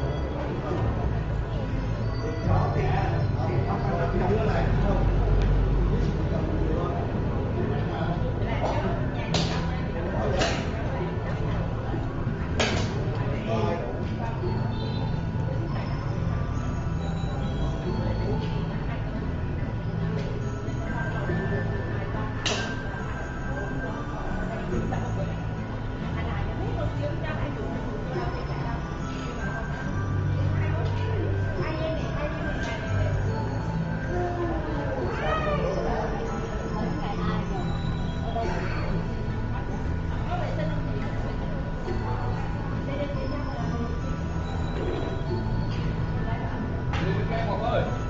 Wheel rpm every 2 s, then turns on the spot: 0, 0, 0, 0, 0, 0, 0, 0, 0, 0, 0, 0, 0, 0, 0, 0, 0, 0, 0, 0, 0, 0, 0, 0.
none